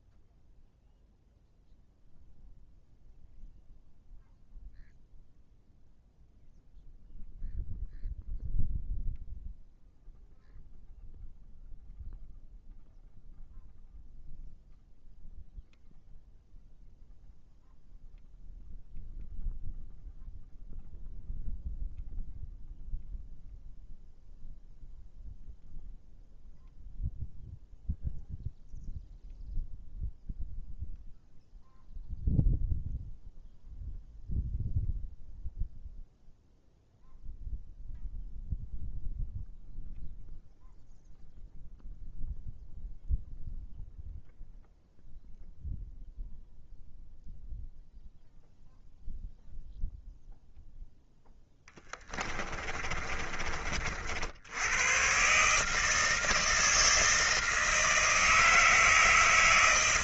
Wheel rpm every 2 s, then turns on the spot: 0, 0, 0, 0, 0, 0, 0, 0, 0, 0, 0, 0, 0, 0, 0, 0, 0, 0, 0, 0, 0, 0, 0, 0, 0, 0, 30, 90, 160, 160.
52-54